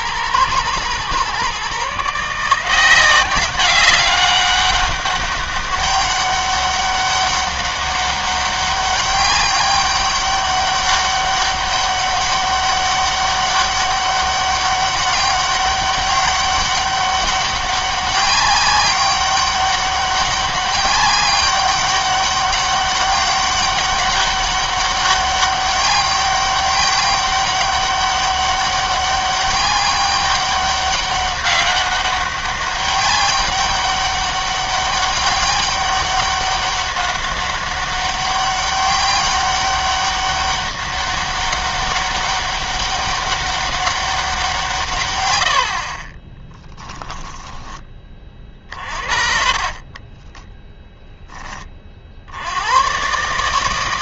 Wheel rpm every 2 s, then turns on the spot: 110, 170, 200, 200, 200, 200, 200, 200, 200, 200, 200, 200, 200, 200, 200, 200, 200, 200, 200, 190, 200, 200, 150, 10, 40, 20, 100.
46-52